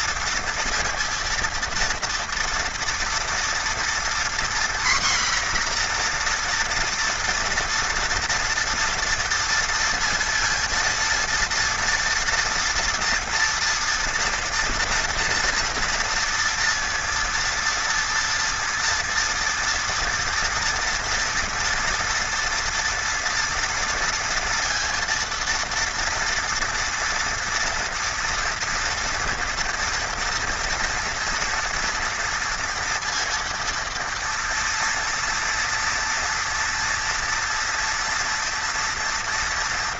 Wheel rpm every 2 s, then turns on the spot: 230, 240, 250, 240, 230, 230, 230, 230, 230, 230, 230, 230, 230, 230, 230, 230, 240, 240, 230, 230.
none